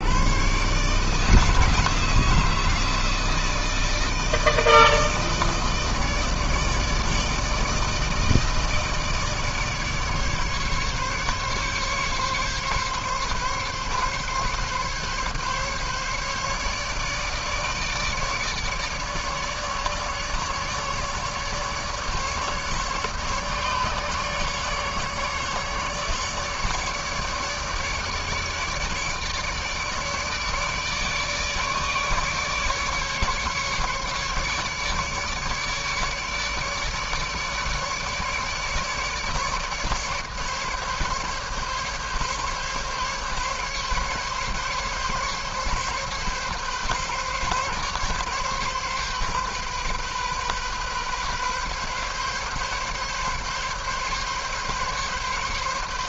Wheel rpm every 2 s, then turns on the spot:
150, 160, 160, 160, 160, 140, 140, 140, 150, 150, 150, 150, 150, 150, 150, 150, 150, 150, 150, 150, 140, 140, 140, 140, 130, 130, 140, 140.
none